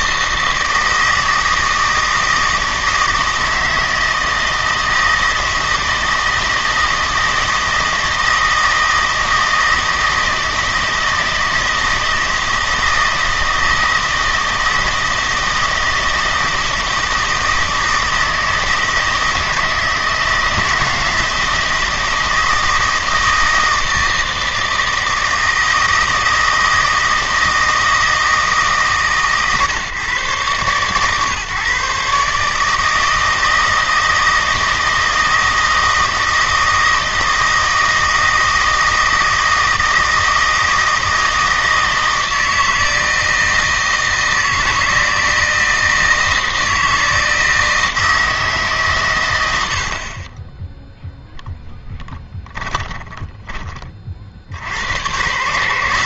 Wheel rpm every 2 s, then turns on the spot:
160, 160, 160, 160, 160, 160, 160, 160, 160, 160, 160, 160, 160, 160, 150, 130, 150, 160, 160, 160, 160, 160, 160, 160, 150, 10, 10, 80.
52-54